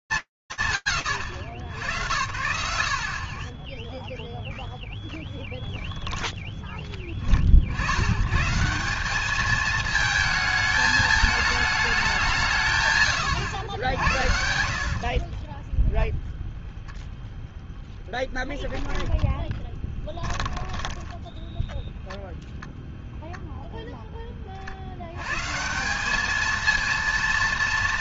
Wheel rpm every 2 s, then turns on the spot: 120, 0, 0, 40, 220, 210, 100, 20, 0, 10, 10, 0, 90, 230.
12-16 20-22